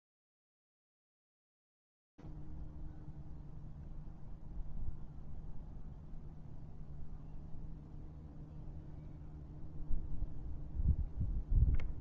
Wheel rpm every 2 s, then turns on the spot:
0, 0, 0, 0, 0, 0.
none